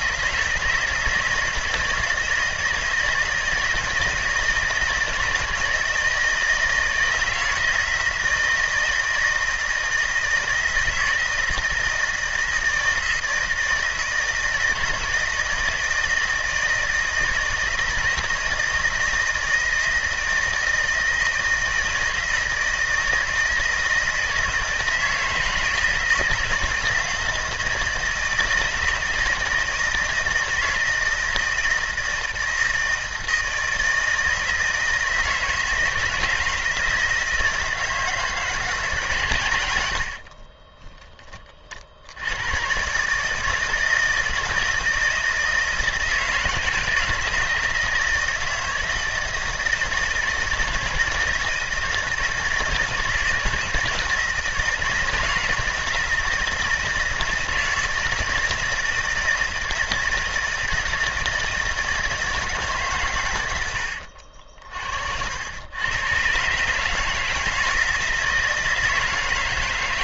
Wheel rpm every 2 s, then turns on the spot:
160, 160, 160, 170, 160, 160, 160, 160, 160, 170, 160, 160, 160, 160, 160, 160, 160, 160, 160, 140, 20, 130, 160, 160, 160, 160, 160, 160, 160, 160, 160, 140, 60, 150, 160.
40-42